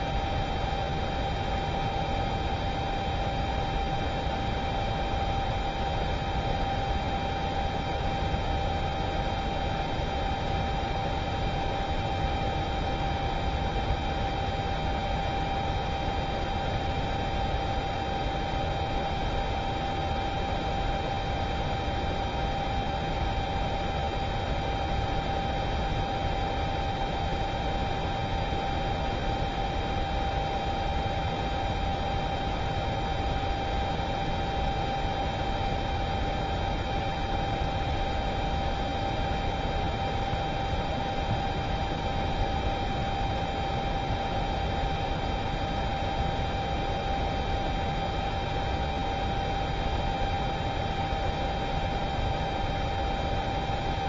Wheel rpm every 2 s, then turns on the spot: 0, 0, 0, 0, 0, 0, 0, 0, 0, 0, 0, 0, 0, 0, 0, 0, 0, 0, 0, 0, 0, 0, 0, 0, 0, 0, 0.
none